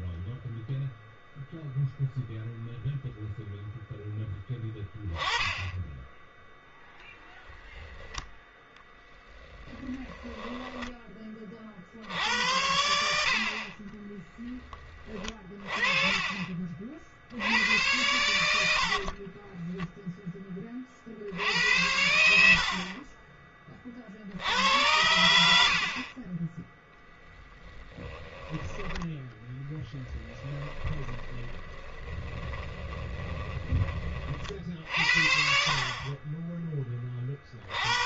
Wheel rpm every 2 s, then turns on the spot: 0, 0, 10, 10, 0, 10, 80, 20, 40, 70, 20, 50, 80, 10, 20, 10, 20, 60, 20.
18-20 22-24 28-34